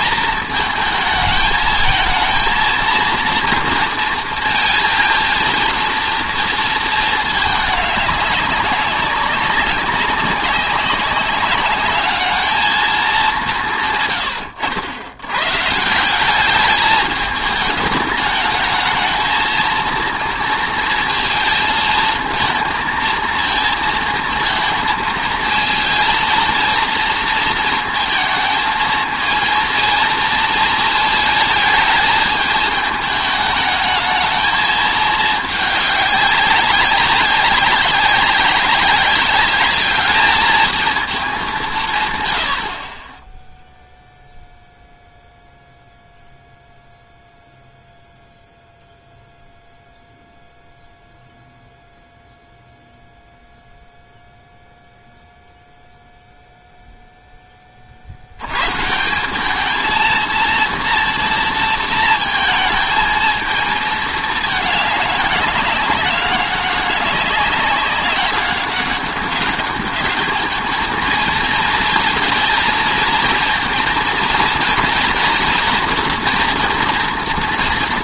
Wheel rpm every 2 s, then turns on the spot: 220, 230, 230, 230, 200, 190, 220, 100, 200, 220, 230, 230, 220, 230, 220, 220, 210, 220, 190, 190, 220, 60, 0, 0, 0, 0, 0, 0, 0, 120, 230, 230, 210, 200, 200, 220, 230, 230, 240.
14-16